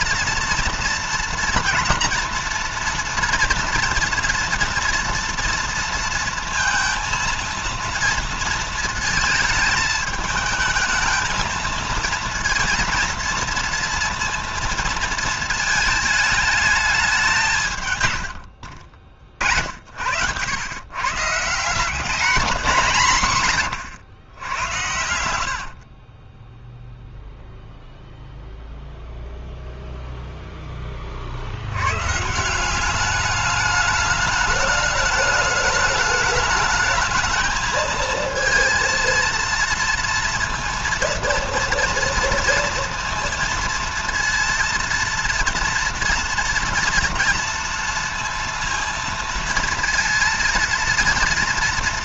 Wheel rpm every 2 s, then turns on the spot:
230, 230, 230, 230, 230, 220, 230, 230, 210, 70, 120, 170, 90, 0, 0, 20, 190, 210, 210, 230, 230, 230, 230, 240, 230, 230.
18-20